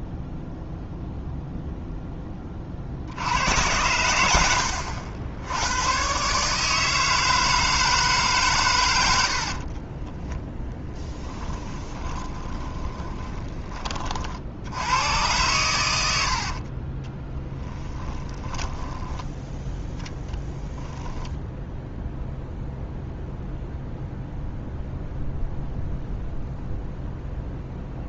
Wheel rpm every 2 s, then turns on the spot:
0, 70, 80, 160, 70, 20, 20, 110, 30, 10, 10, 0, 0, 0.
8-14 16-18 20-22